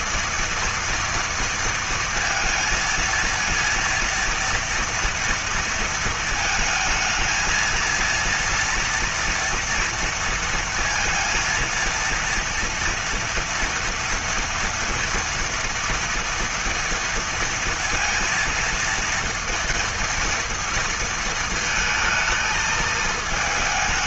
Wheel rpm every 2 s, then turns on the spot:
230, 230, 230, 220, 230, 230, 230, 230, 230, 230, 230, 220.
none